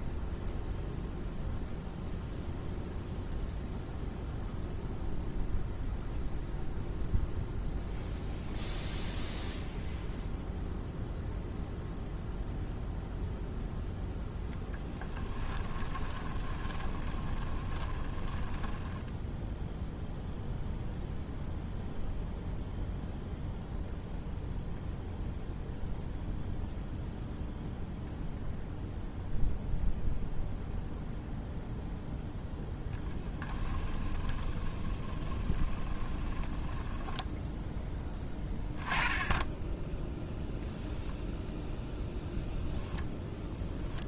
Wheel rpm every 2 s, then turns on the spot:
0, 0, 0, 0, 0, 0, 0, 10, 20, 10, 0, 0, 0, 0, 0, 0, 10, 20, 10, 10, 0, 0.
16-20 32-38